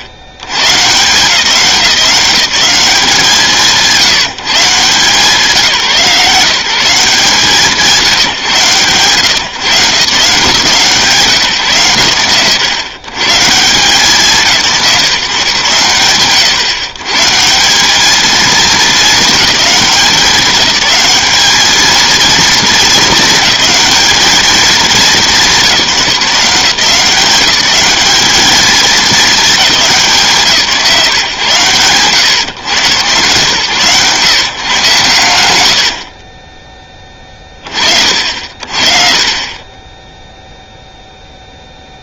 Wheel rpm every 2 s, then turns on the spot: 100, 190, 150, 170, 140, 160, 110, 160, 140, 220, 210, 230, 210, 170, 210, 150, 120, 130, 30, 60, 0.
none